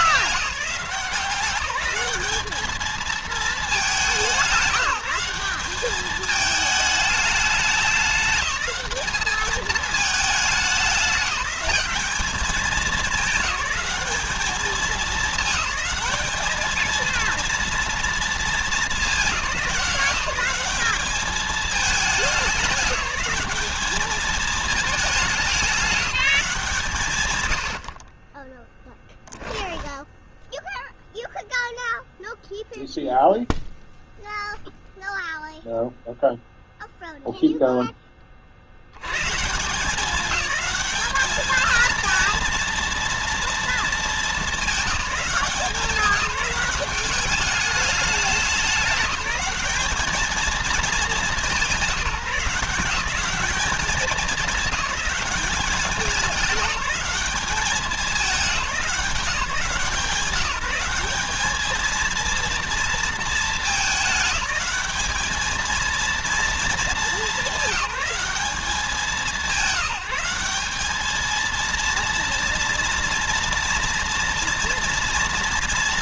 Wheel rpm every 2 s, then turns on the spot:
170, 220, 180, 220, 210, 210, 210, 210, 220, 220, 190, 200, 210, 150, 0, 0, 0, 0, 0, 80, 200, 230, 200, 200, 200, 210, 180, 190, 190, 200, 200, 230, 210, 210, 190, 210, 230, 230.
none